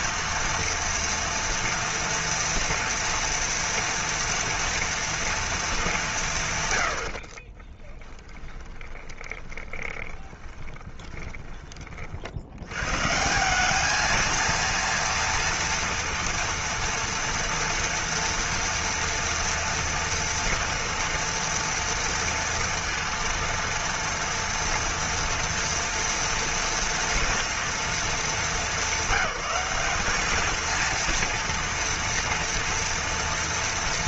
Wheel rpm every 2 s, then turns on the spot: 230, 230, 230, 160, 20, 20, 70, 230, 230, 230, 230, 230, 230, 230, 220, 210, 230.
8-12